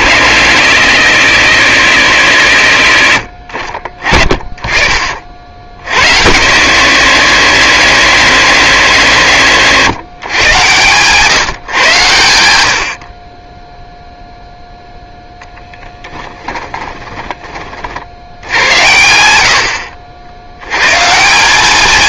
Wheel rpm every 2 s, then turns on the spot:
160, 80, 40, 150, 130, 130, 60, 0, 20, 90, 110.
16-18